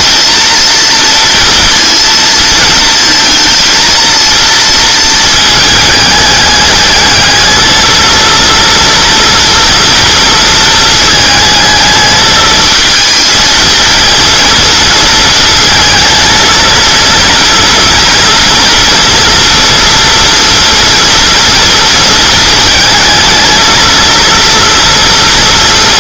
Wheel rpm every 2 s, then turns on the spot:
230, 230, 230, 210, 230, 220, 220, 230, 230, 230, 230, 230, 230.
none